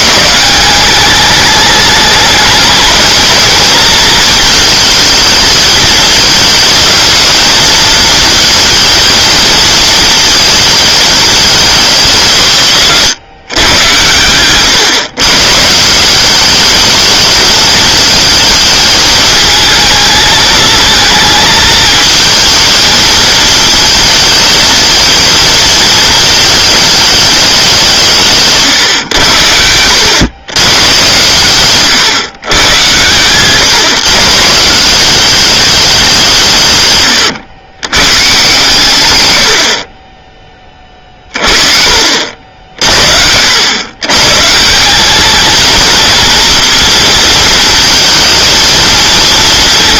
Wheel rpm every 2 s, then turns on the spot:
190, 220, 220, 220, 230, 220, 160, 130, 210, 220, 220, 230, 220, 220, 140, 130, 110, 170, 140, 140, 30, 60, 180, 230, 230.
none